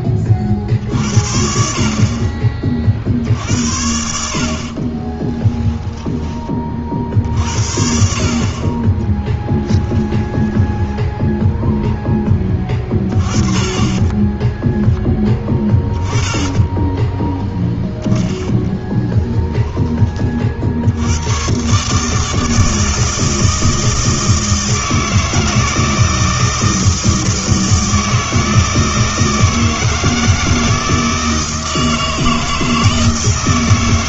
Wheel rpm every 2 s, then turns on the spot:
50, 40, 40, 40, 30, 20, 20, 10, 10, 10, 60, 160, 160, 160, 160, 160, 160.
4-6 10-12 16-20